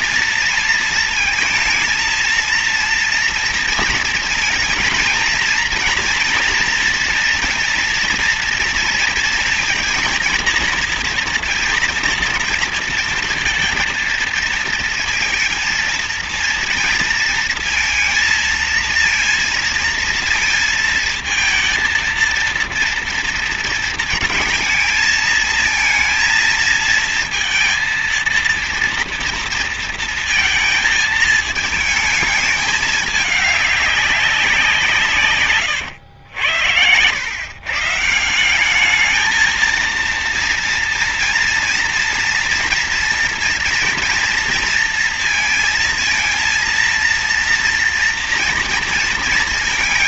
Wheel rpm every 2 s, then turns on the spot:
230, 230, 230, 240, 230, 230, 230, 230, 230, 230, 220, 230, 220, 230, 230, 220, 210, 180, 90, 190, 230, 240, 230, 230, 230.
none